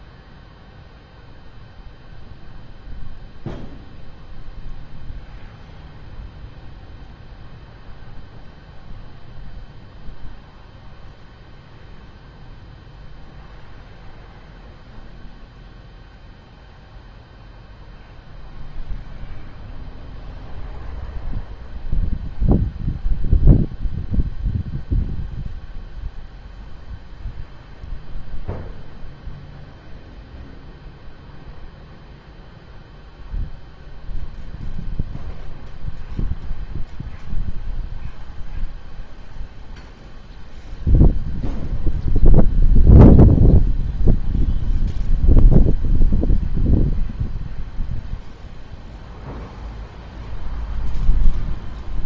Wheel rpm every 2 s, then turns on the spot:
0, 0, 0, 0, 0, 0, 0, 0, 0, 0, 0, 0, 0, 0, 0, 0, 0, 0, 0, 0, 0, 0, 0, 0, 0, 0.
none